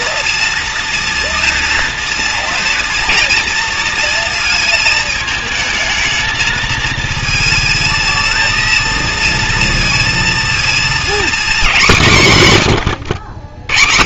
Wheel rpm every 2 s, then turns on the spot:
230, 230, 220, 220, 230, 230, 130.
none